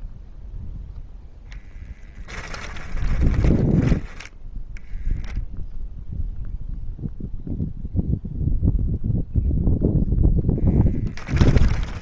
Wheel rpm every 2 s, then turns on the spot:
10, 20, 0, 0, 0, 20.
2-4 10-12